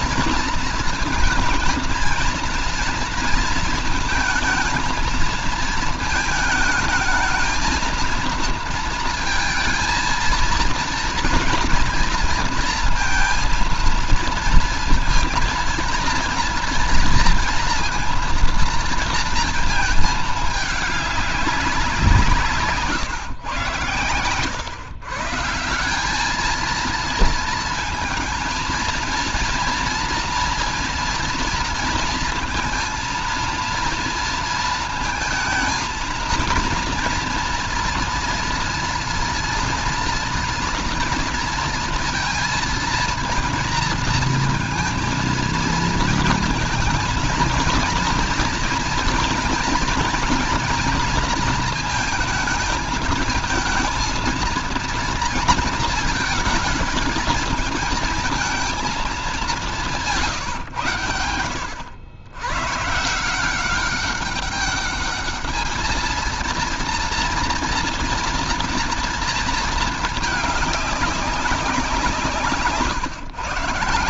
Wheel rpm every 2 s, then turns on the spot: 230, 230, 220, 220, 230, 230, 230, 230, 230, 230, 220, 150, 130, 220, 230, 240, 230, 220, 230, 230, 230, 230, 230, 230, 230, 230, 230, 230, 230, 230, 140, 110, 200, 230, 230, 210, 160.
none